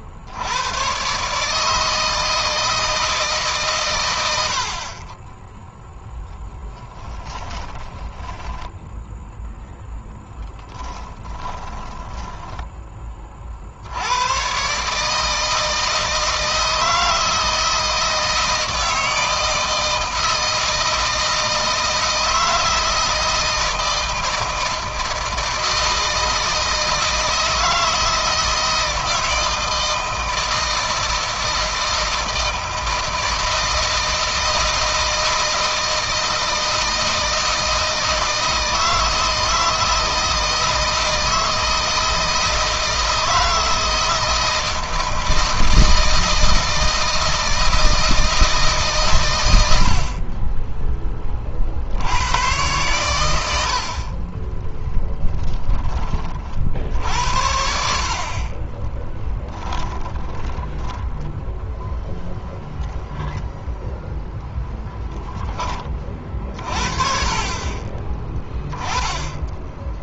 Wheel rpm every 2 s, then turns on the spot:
50, 160, 70, 10, 10, 10, 10, 130, 160, 160, 160, 160, 160, 160, 160, 160, 160, 160, 160, 160, 160, 160, 160, 160, 150, 20, 110, 10, 60, 30, 10, 0, 0, 40, 10.
6-12 54-56 58-62